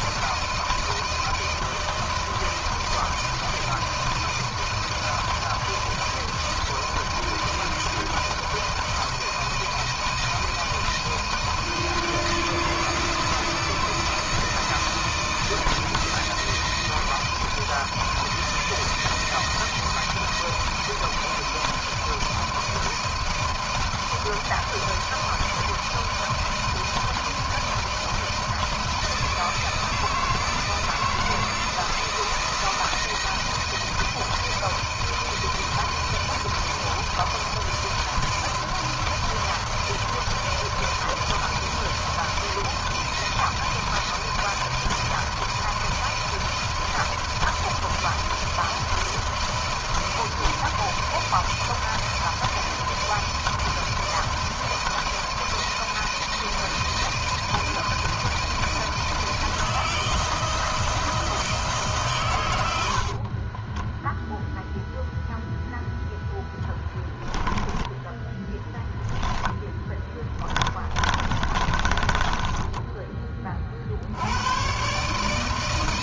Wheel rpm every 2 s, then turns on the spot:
160, 170, 160, 160, 160, 160, 170, 170, 160, 160, 160, 160, 170, 160, 170, 170, 160, 160, 170, 160, 160, 160, 160, 160, 160, 160, 170, 160, 160, 160, 160, 70, 0, 0, 10, 30, 10, 140.
62-64 68-72